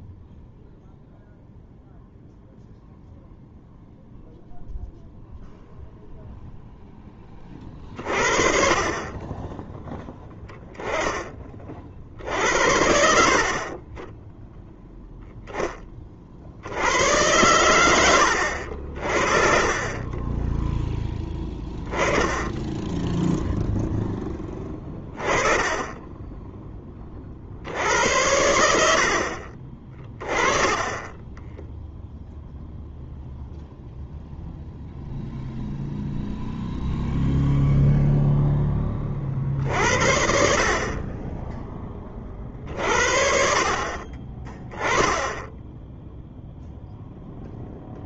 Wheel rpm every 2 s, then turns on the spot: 0, 0, 0, 0, 40, 10, 70, 10, 70, 70, 10, 10, 10, 10, 80, 20, 0, 0, 0, 0, 50, 50, 20, 0.
20-22